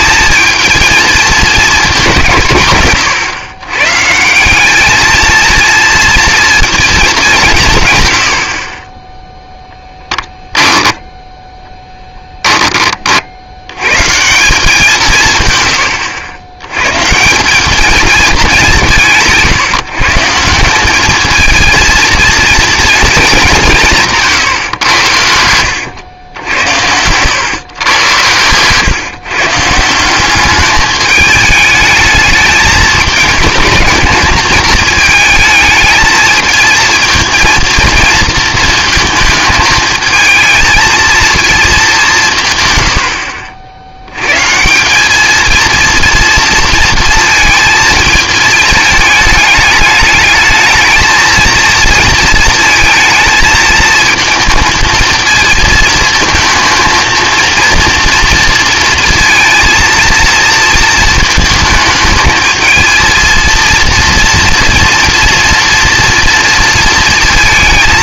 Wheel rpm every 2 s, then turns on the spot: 230, 140, 200, 230, 30, 10, 20, 190, 110, 190, 180, 230, 120, 90, 130, 210, 210, 220, 220, 230, 220, 120, 170, 230, 210, 220, 220, 230, 230, 230, 230, 220, 230, 230.
none